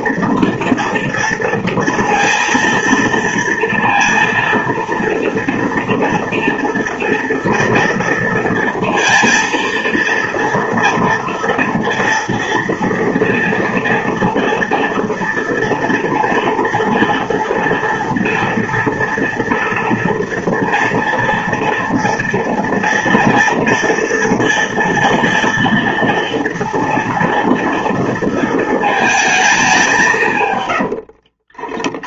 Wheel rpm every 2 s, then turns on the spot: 230, 230, 230, 230, 230, 230, 230, 230, 230, 230, 240, 230, 230, 230, 220, 80.
30-32